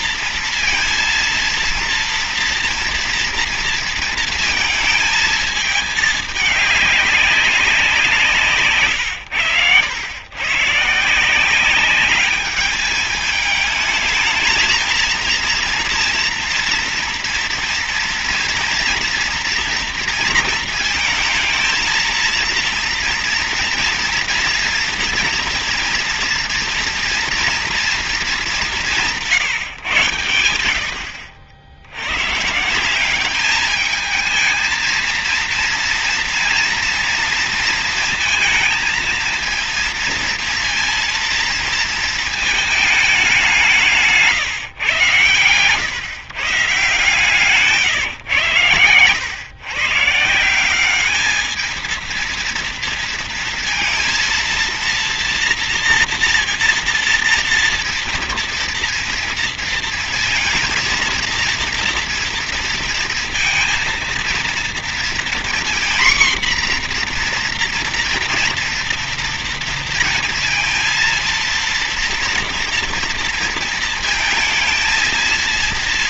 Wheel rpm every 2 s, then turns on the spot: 230, 230, 230, 210, 160, 110, 200, 220, 230, 230, 230, 230, 230, 230, 210, 100, 130, 220, 230, 230, 230, 220, 130, 140, 120, 170, 230, 230, 230, 230, 230, 230, 230, 240, 230, 230, 230, 220.
none